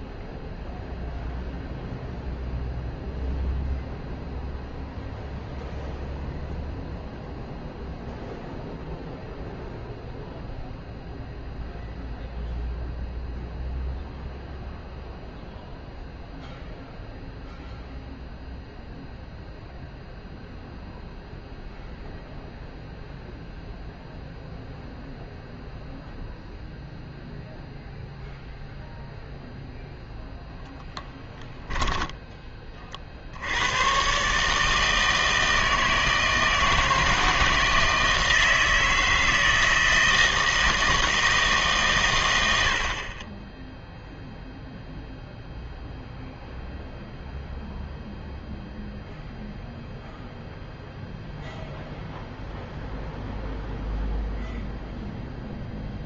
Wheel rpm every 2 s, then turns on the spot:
0, 0, 0, 0, 0, 0, 0, 0, 0, 0, 0, 0, 0, 0, 0, 10, 30, 150, 160, 160, 160, 80, 0, 0, 0, 0, 0, 0.
30-32